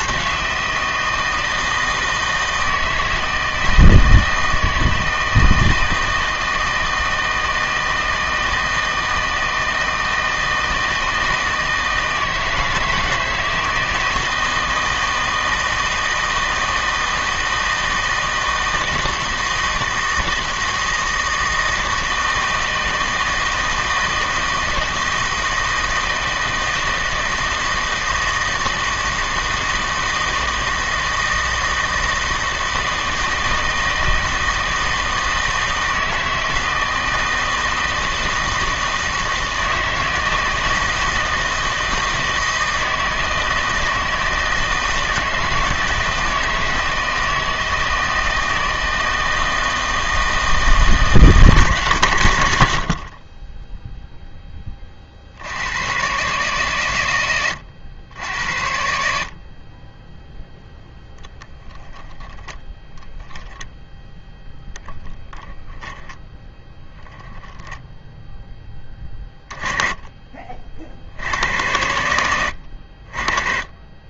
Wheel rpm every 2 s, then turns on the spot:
160, 160, 160, 160, 160, 160, 160, 160, 160, 160, 160, 160, 160, 160, 160, 160, 160, 160, 160, 160, 160, 160, 160, 160, 160, 160, 80, 20, 130, 70, 0, 10, 10, 10, 10, 40, 80.
64-68